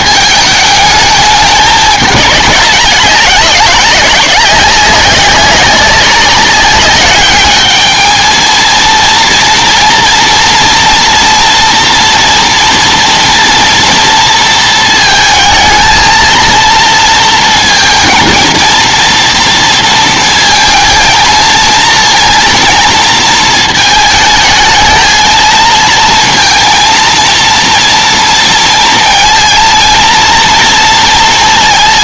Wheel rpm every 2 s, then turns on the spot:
210, 190, 190, 200, 230, 230, 240, 230, 230, 230, 220, 230, 220, 230, 230, 230.
none